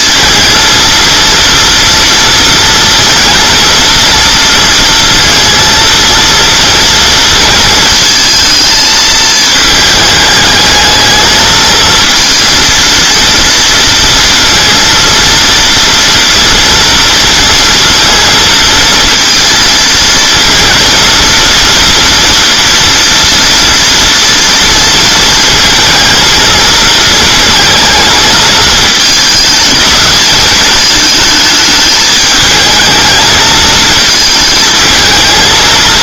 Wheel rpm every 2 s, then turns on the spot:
230, 230, 230, 230, 220, 210, 230, 230, 230, 230, 230, 240, 230, 230, 220, 210, 220, 220.
none